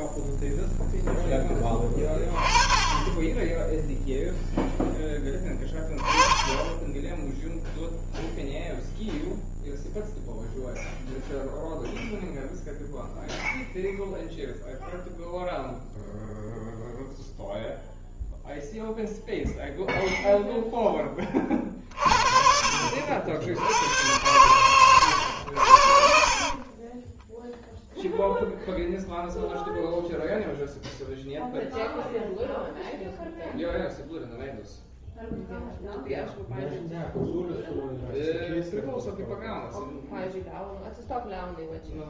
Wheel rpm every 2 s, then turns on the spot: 0, 10, 10, 20, 0, 0, 0, 0, 0, 0, 0, 50, 100, 40, 0, 0, 0, 0, 0, 0, 0.
24-26